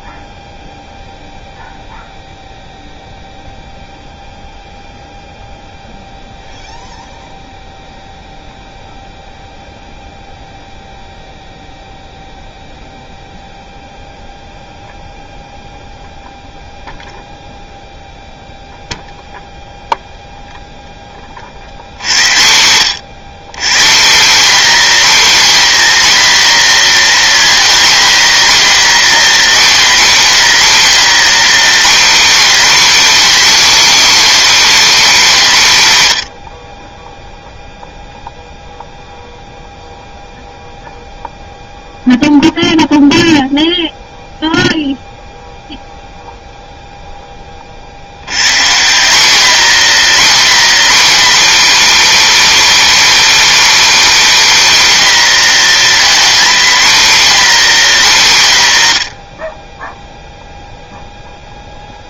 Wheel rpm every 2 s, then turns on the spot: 0, 0, 0, 0, 0, 0, 0, 0, 0, 0, 0, 110, 270, 250, 260, 270, 290, 290, 30, 0, 0, 0, 0, 0, 170, 270, 300, 270, 260, 130, 0.
none